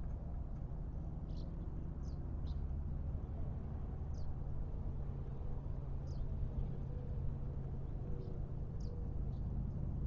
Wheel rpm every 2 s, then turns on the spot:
0, 0, 0, 0, 0.
none